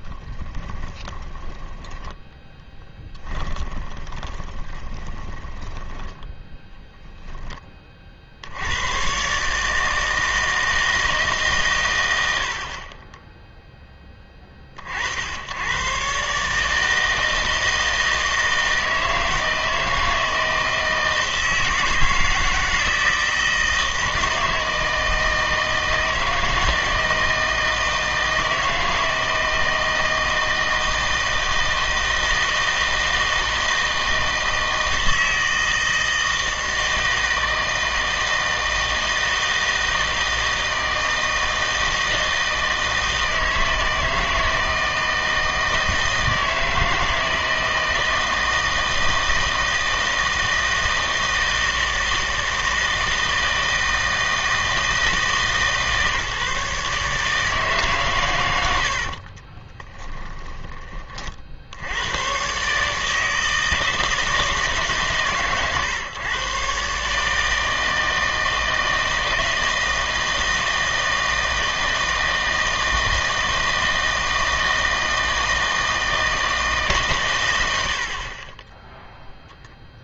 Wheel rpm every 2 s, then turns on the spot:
20, 10, 20, 0, 100, 160, 50, 30, 160, 160, 160, 160, 160, 160, 160, 160, 160, 160, 160, 160, 160, 160, 160, 160, 160, 160, 160, 160, 150, 80, 20, 140, 150, 140, 160, 160, 160, 160, 150, 0.
0-6 58-60